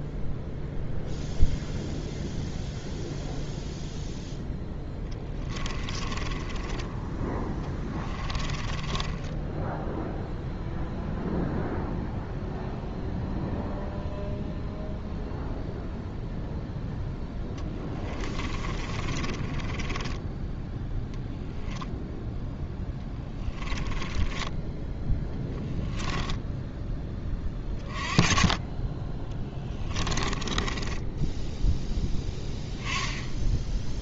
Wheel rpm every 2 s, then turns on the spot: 0, 0, 10, 20, 20, 0, 0, 0, 0, 30, 10, 10, 10, 10, 20, 20, 10.
4-10 18-20 22-26 30-32